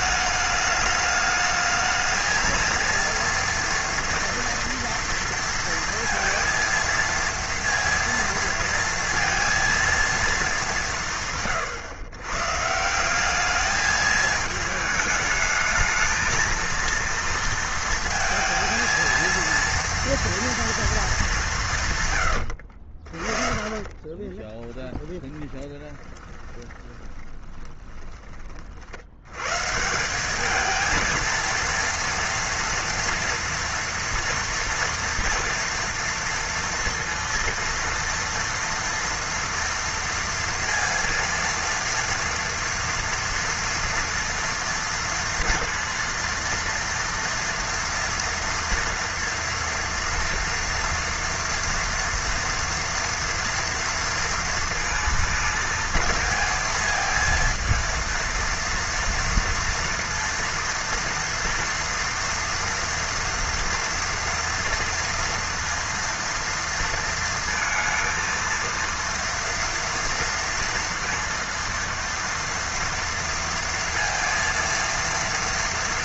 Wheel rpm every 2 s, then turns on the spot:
210, 230, 230, 230, 230, 190, 150, 220, 230, 230, 230, 60, 10, 20, 50, 220, 240, 230, 230, 230, 230, 230, 230, 230, 230, 230, 230, 230, 220, 230, 230, 230, 230, 230, 230, 230, 230, 230.
22-28